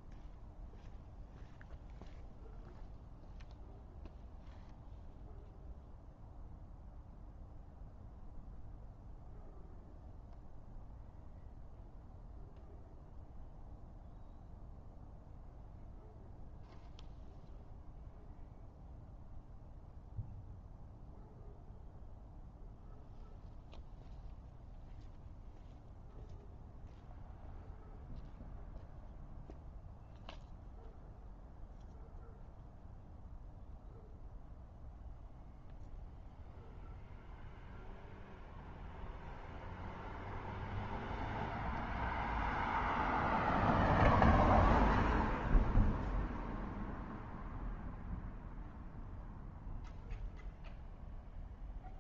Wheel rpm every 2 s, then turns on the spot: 0, 0, 0, 0, 0, 0, 0, 0, 0, 0, 0, 0, 0, 0, 0, 0, 0, 0, 0, 0, 0, 0, 0, 0, 0, 0.
none